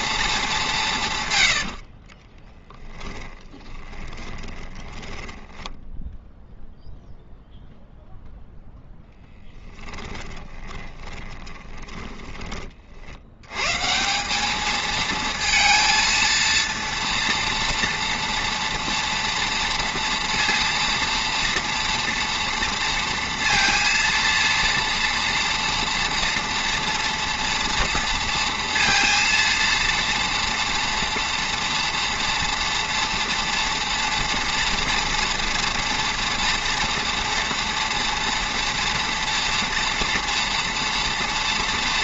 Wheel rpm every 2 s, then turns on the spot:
190, 20, 20, 0, 0, 20, 30, 210, 230, 230, 230, 240, 230, 230, 230, 240, 230, 230, 230, 230, 230.
2-6 10-12